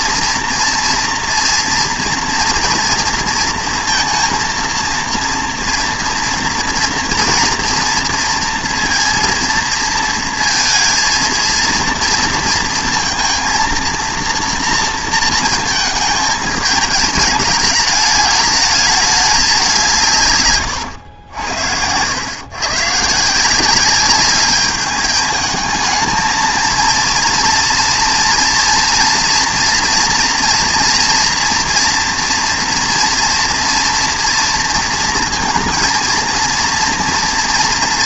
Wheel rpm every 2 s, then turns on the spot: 230, 230, 230, 230, 230, 230, 230, 230, 210, 210, 120, 120, 200, 230, 230, 240, 230, 230, 230.
20-22